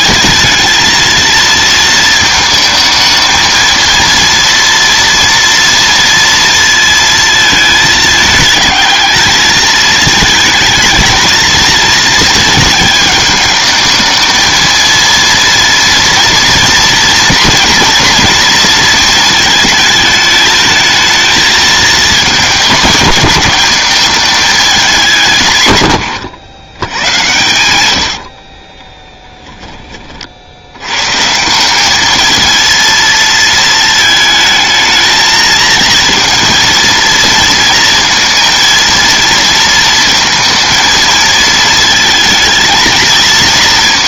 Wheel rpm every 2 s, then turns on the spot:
220, 220, 230, 230, 220, 220, 210, 230, 230, 220, 220, 210, 190, 110, 20, 110, 230, 220, 230, 230, 230, 230.
28-30